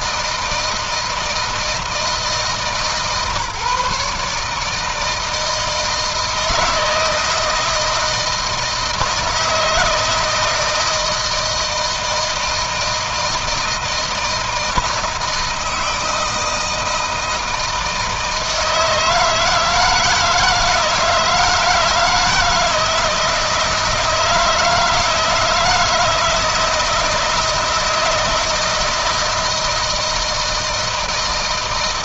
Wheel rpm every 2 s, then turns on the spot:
160, 160, 150, 160, 160, 160, 160, 160, 160, 160, 160, 160, 160, 160, 160, 160.
none